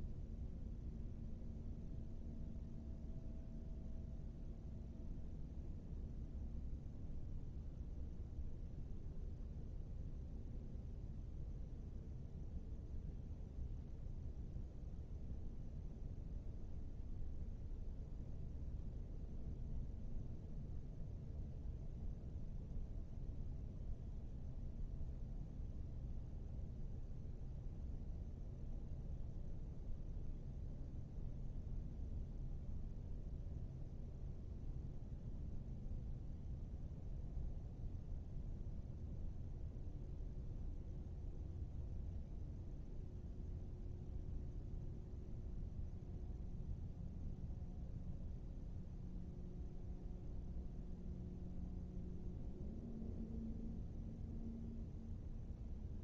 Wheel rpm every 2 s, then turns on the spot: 0, 0, 0, 0, 0, 0, 0, 0, 0, 0, 0, 0, 0, 0, 0, 0, 0, 0, 0, 0, 0, 0, 0, 0, 0, 0, 0, 0.
none